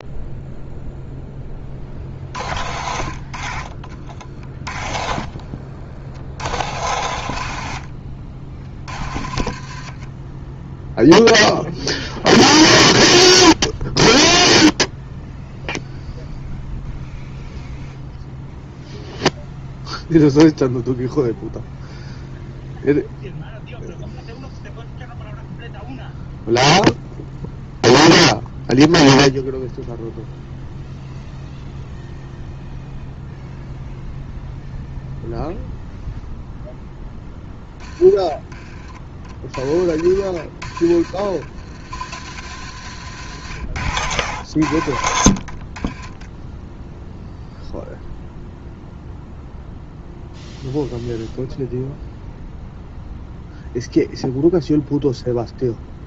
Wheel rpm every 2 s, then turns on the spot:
0, 50, 30, 80, 40, 0, 0, 0, 0, 0, 0, 0, 0, 0, 0, 0, 0, 0, 10, 30, 50, 90, 70, 0, 0, 0, 0, 0.
none